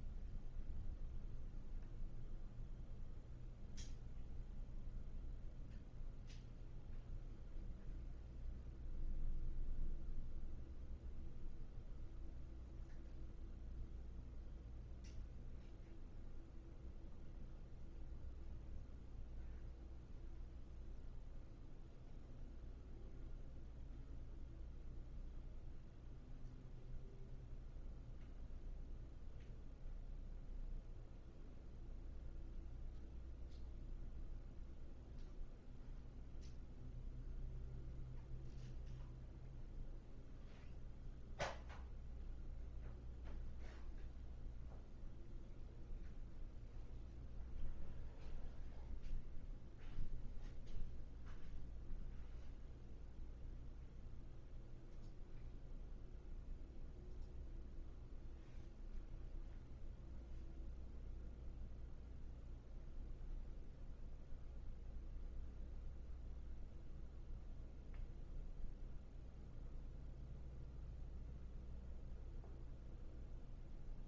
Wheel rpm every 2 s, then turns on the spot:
0, 0, 0, 0, 0, 0, 0, 0, 0, 0, 0, 0, 0, 0, 0, 0, 0, 0, 0, 0, 0, 0, 0, 0, 0, 0, 0, 0, 0, 0, 0, 0, 0, 0, 0, 0, 0.
none